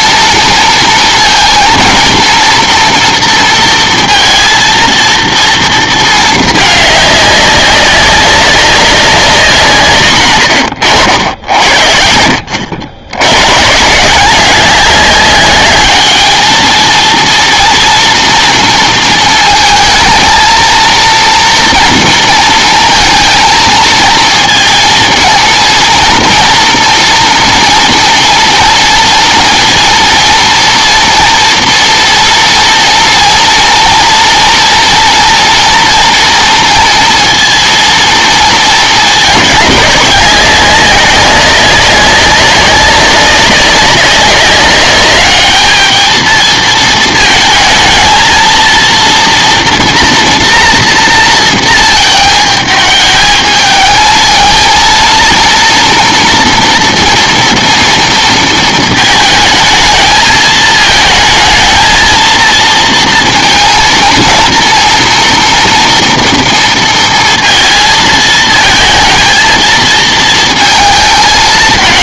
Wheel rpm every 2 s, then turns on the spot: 230, 230, 230, 210, 200, 110, 80, 200, 220, 230, 230, 230, 230, 230, 230, 230, 230, 230, 230, 220, 200, 200, 200, 230, 230, 230, 220, 230, 230, 220, 220, 230, 230, 230, 220, 220.
none